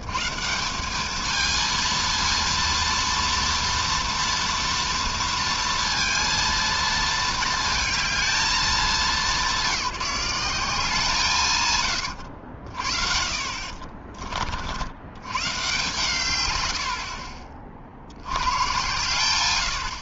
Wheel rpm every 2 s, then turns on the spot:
180, 230, 230, 230, 210, 180, 90, 60, 110, 100.
12-14